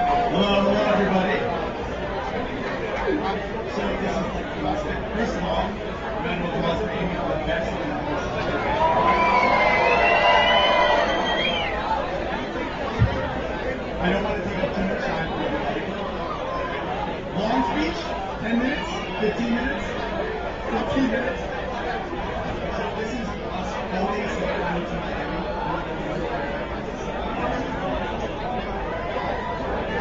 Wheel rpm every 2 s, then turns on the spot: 0, 0, 0, 0, 0, 0, 0, 0, 0, 0, 0, 0, 0, 0, 0.
none